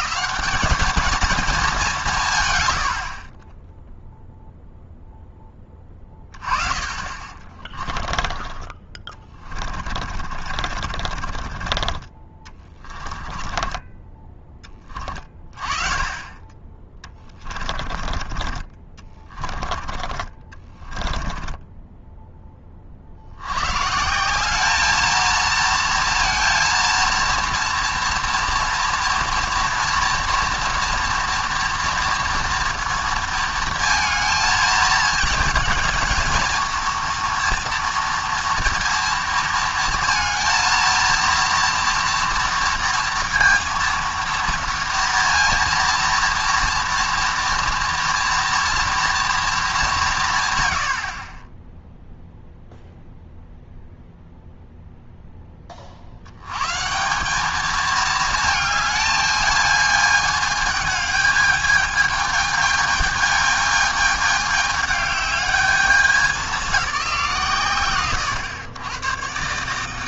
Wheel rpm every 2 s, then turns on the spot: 220, 110, 0, 30, 20, 40, 20, 20, 20, 30, 30, 30, 200, 230, 230, 230, 230, 220, 230, 230, 230, 230, 230, 230, 240, 110, 0, 0, 130, 220, 210, 220, 210, 200, 110.
10-14 20-22